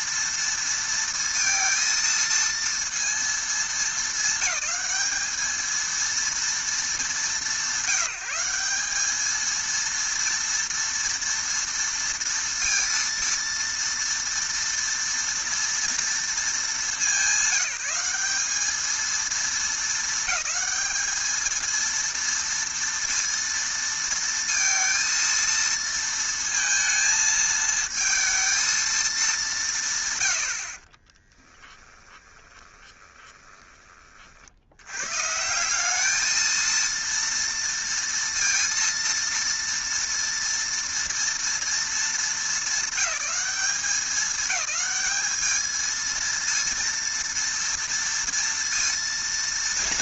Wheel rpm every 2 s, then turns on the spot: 230, 230, 200, 220, 200, 230, 230, 230, 210, 210, 220, 230, 230, 230, 230, 60, 20, 90, 230, 230, 230, 210, 210, 230, 230.
32-34